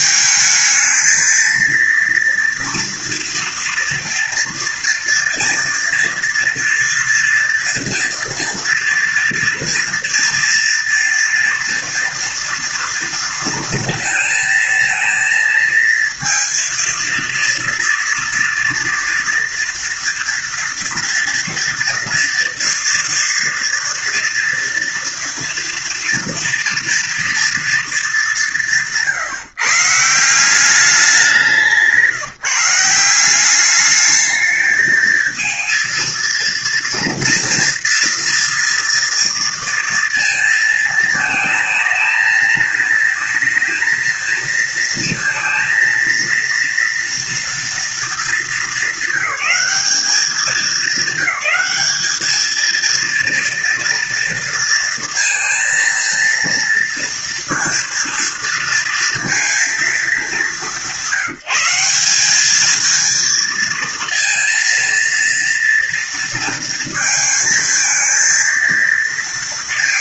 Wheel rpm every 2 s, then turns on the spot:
220, 230, 230, 230, 230, 230, 230, 230, 230, 230, 230, 240, 230, 230, 160, 190, 170, 220, 230, 230, 230, 220, 230, 230, 200, 210, 230, 230, 230, 230, 190, 230, 230, 230, 230.
none